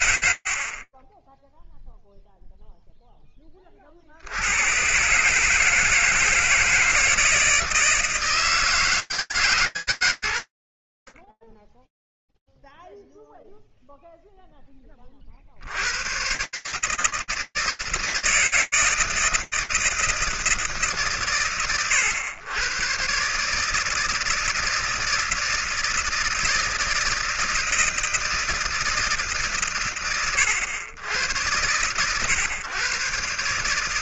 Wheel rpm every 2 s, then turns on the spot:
30, 0, 110, 160, 160, 50, 0, 0, 120, 160, 170, 100, 160, 160, 160, 90, 120.
0-2